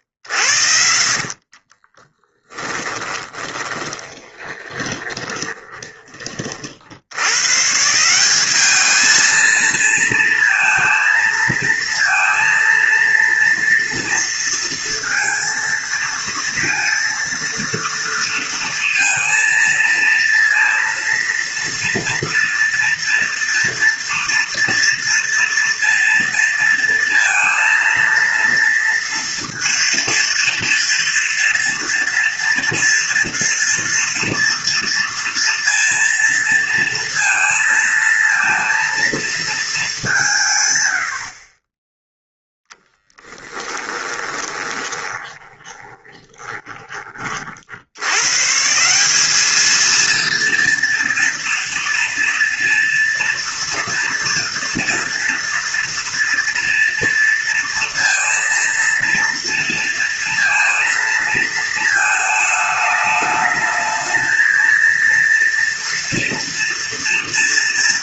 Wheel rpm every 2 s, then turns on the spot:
60, 10, 20, 90, 220, 230, 230, 230, 230, 230, 230, 230, 230, 230, 230, 230, 230, 240, 230, 230, 90, 10, 20, 30, 190, 230, 230, 230, 230, 230, 230, 210, 230, 230.
0-6 42-46